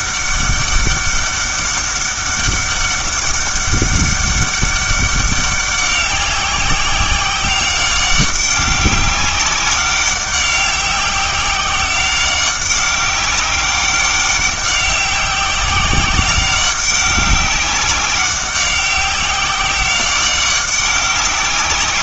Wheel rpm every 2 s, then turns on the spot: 200, 200, 200, 190, 200, 190, 190, 190, 190, 190, 190.
none